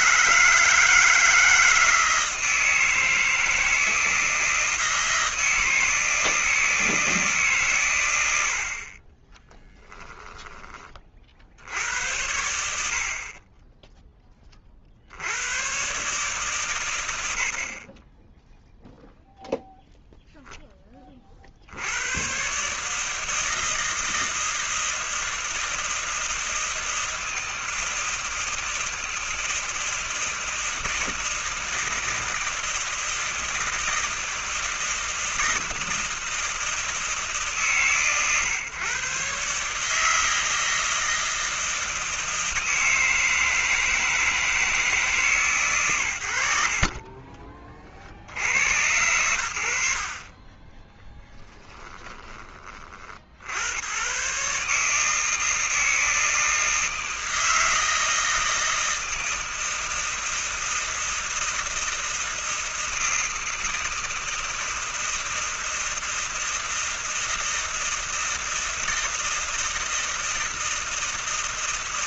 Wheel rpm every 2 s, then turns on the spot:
160, 160, 160, 160, 30, 50, 40, 90, 90, 0, 40, 160, 160, 160, 160, 160, 160, 160, 150, 130, 160, 160, 150, 20, 100, 10, 40, 150, 160, 160, 160, 160, 160, 160, 160, 160.
none